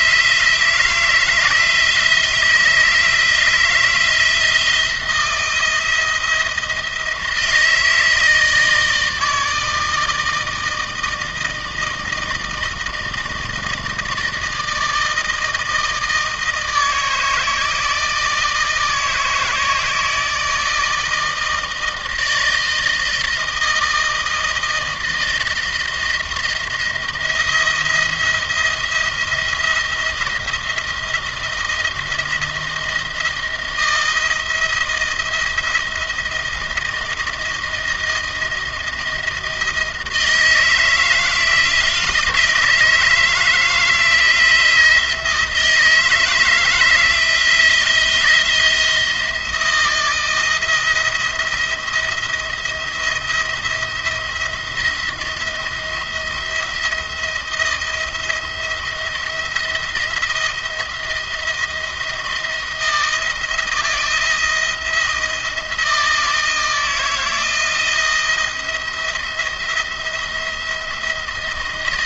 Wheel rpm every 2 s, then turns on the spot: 170, 160, 170, 160, 160, 160, 160, 160, 160, 160, 160, 160, 160, 170, 170, 170, 170, 170, 170, 170, 160, 160, 170, 160, 170, 170, 170, 170, 170, 170, 170, 170, 170, 160, 170, 160.
none